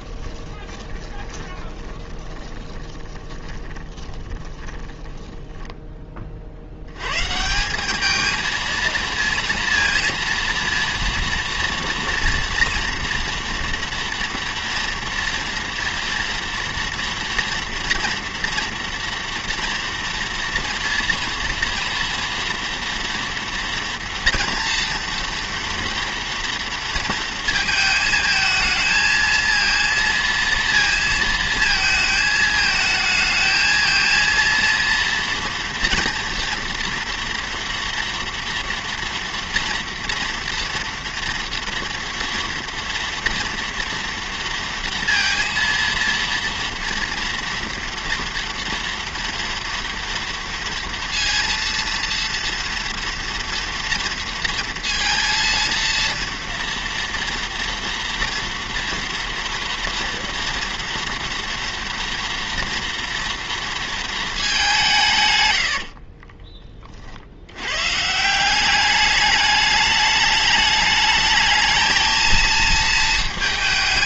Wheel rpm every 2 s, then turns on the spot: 20, 20, 10, 70, 230, 230, 230, 230, 230, 230, 230, 230, 240, 230, 220, 230, 220, 230, 230, 240, 230, 230, 230, 230, 230, 230, 230, 230, 240, 230, 230, 230, 190, 20, 190, 210, 220.
0-6